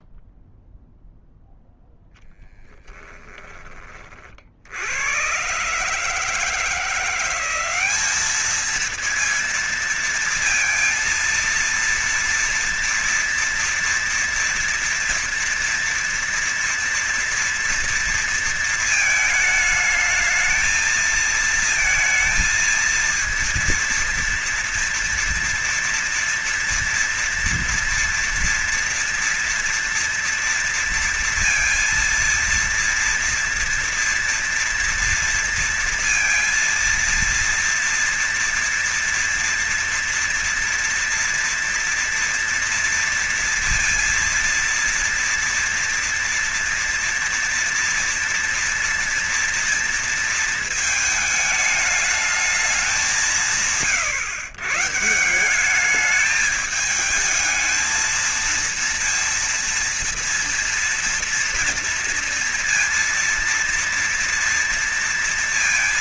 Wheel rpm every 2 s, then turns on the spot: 0, 0, 40, 140, 200, 230, 230, 230, 230, 230, 220, 220, 230, 230, 230, 240, 230, 230, 230, 230, 240, 240, 230, 230, 240, 230, 210, 150, 200, 220, 230, 230, 230.
none